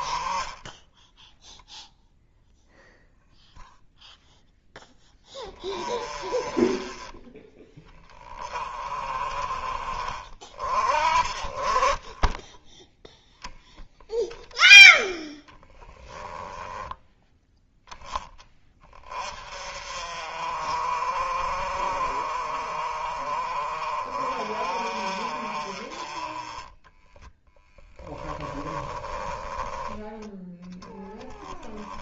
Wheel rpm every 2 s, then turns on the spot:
20, 0, 0, 20, 30, 30, 10, 10, 10, 20, 40, 40, 40, 20, 20, 20.
12-14 26-30